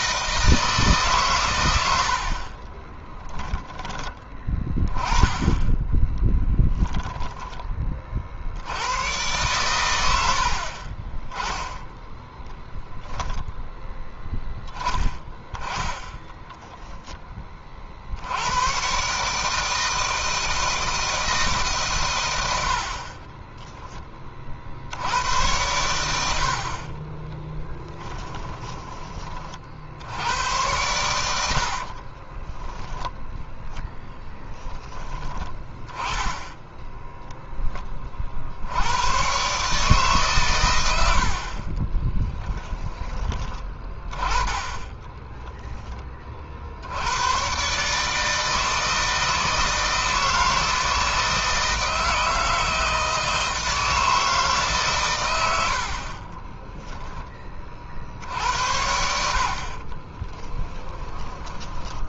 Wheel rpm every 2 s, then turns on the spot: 160, 40, 10, 10, 80, 50, 10, 30, 10, 100, 160, 80, 50, 60, 20, 100, 20, 10, 10, 60, 120, 10, 20, 50, 160, 160, 160, 150, 20, 80, 30.
2-4 6-8 12-14 28-30 32-34 56-58 60-62